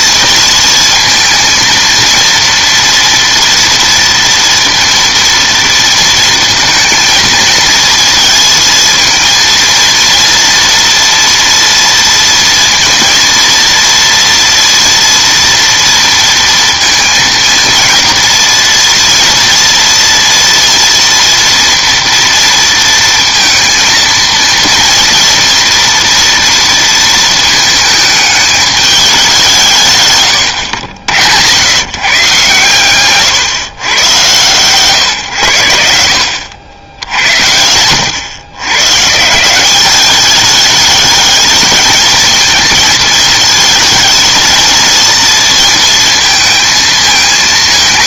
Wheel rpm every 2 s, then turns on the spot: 230, 230, 230, 230, 230, 240, 230, 230, 230, 230, 230, 230, 230, 230, 210, 90, 130, 120, 90, 120, 210, 220, 230, 230.
none